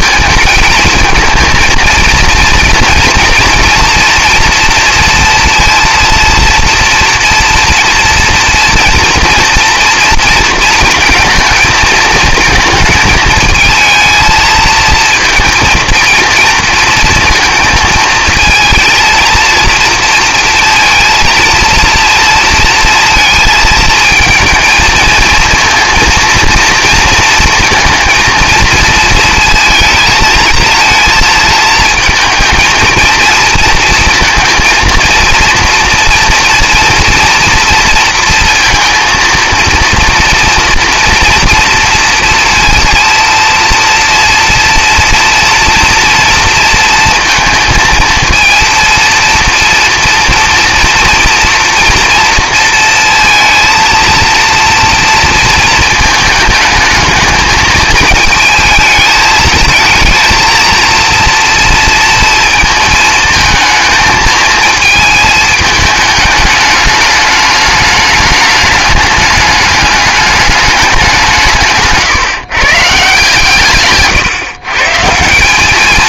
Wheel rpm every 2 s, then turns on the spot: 220, 230, 230, 230, 230, 230, 220, 230, 220, 220, 230, 230, 220, 230, 230, 220, 230, 230, 230, 230, 230, 230, 230, 230, 230, 230, 230, 230, 220, 220, 230, 220, 220, 210, 210, 200, 140, 140.
none